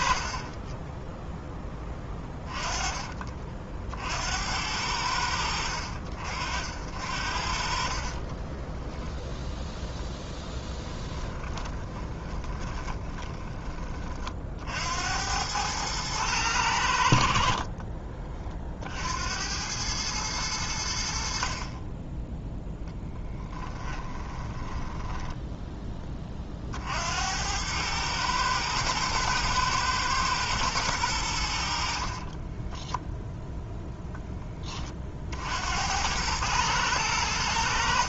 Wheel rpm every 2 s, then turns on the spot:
10, 30, 50, 60, 10, 20, 20, 90, 60, 70, 70, 10, 10, 60, 110, 110, 10, 30, 100.
10-14 22-26 32-34